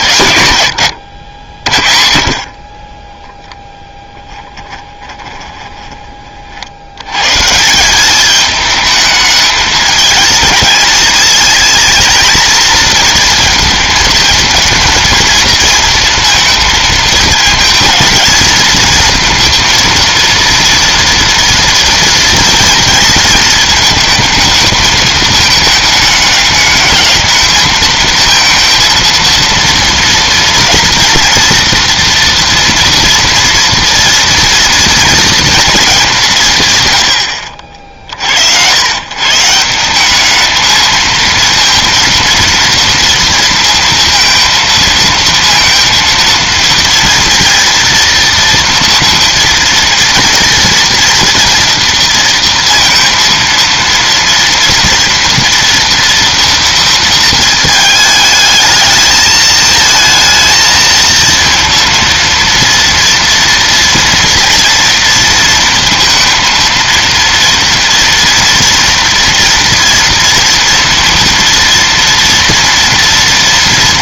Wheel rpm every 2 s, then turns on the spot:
120, 40, 20, 60, 210, 220, 230, 220, 220, 230, 230, 230, 220, 210, 230, 230, 230, 230, 140, 90, 220, 230, 230, 230, 230, 230, 230, 230, 230, 210, 220, 230, 240, 230, 240, 240, 230.
0-6